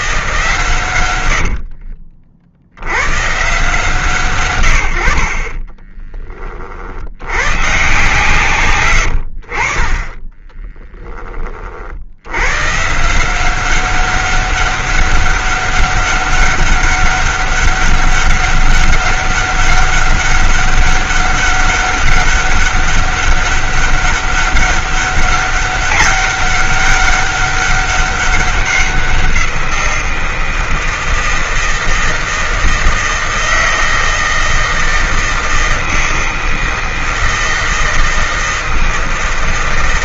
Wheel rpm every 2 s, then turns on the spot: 140, 70, 90, 50, 130, 30, 120, 200, 200, 200, 200, 200, 200, 200, 190, 170, 160, 160, 160, 160.
8-12